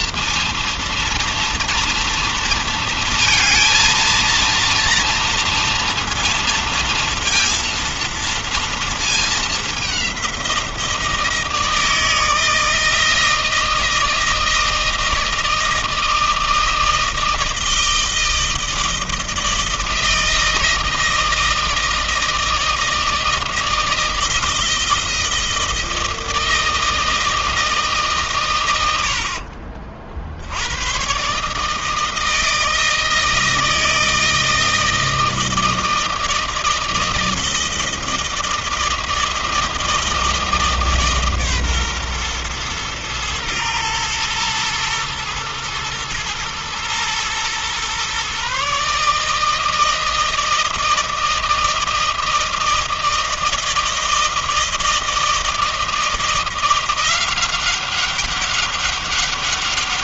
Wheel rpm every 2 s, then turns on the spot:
230, 230, 230, 230, 220, 170, 160, 160, 160, 160, 160, 160, 160, 160, 70, 130, 160, 160, 160, 160, 150, 110, 110, 120, 150, 160, 160, 160, 180, 200.
28-30